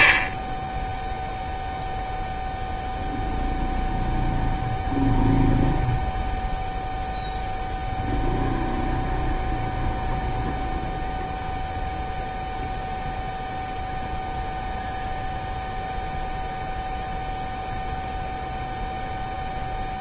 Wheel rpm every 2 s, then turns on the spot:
0, 0, 0, 0, 0, 0, 0, 0, 0, 0.
none